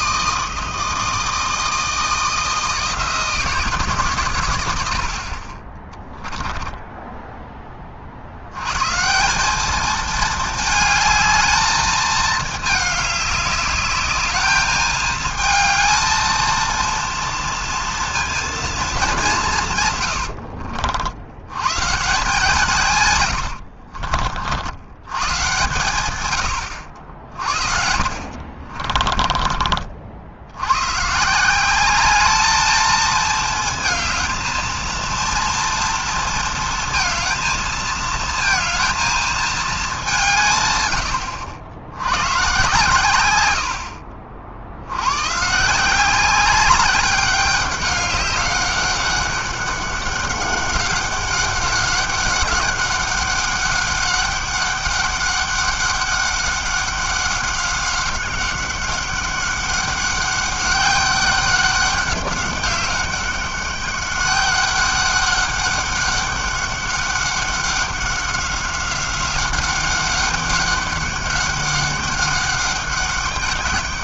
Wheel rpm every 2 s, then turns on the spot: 160, 160, 90, 10, 130, 220, 210, 210, 230, 230, 70, 150, 80, 80, 50, 100, 220, 230, 230, 220, 120, 110, 80, 200, 200, 200, 200, 200, 200, 200, 200, 200, 200, 200, 190, 200, 200.
6-8 28-30